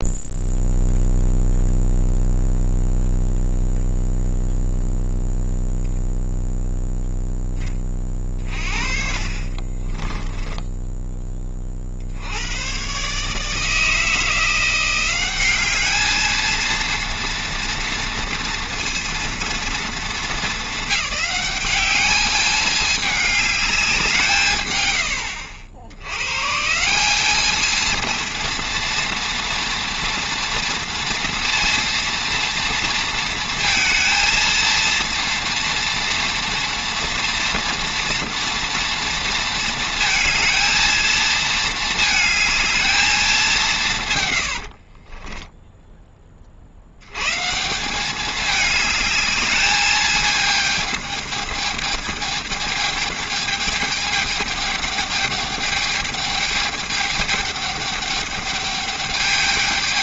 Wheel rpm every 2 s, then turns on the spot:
0, 0, 0, 0, 40, 10, 110, 170, 230, 230, 200, 210, 110, 160, 230, 230, 230, 230, 230, 240, 230, 220, 70, 60, 210, 220, 210, 210, 210, 210.
8-12 44-46